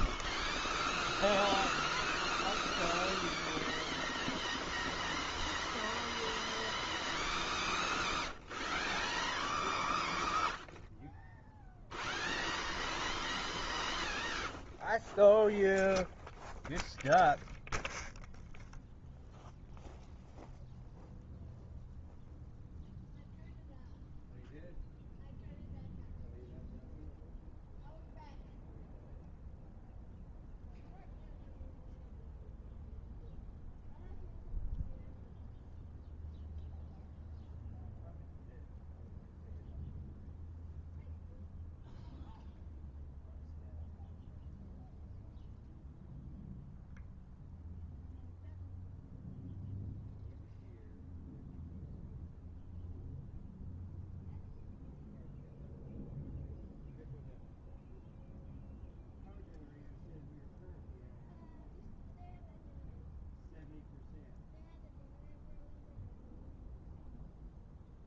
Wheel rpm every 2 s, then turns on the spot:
0, 0, 0, 0, 0, 0, 0, 0, 0, 0, 0, 0, 0, 0, 0, 0, 0, 0, 0, 0, 0, 0, 0, 0, 0, 0, 0, 0, 0, 0, 0, 0, 0, 0.
none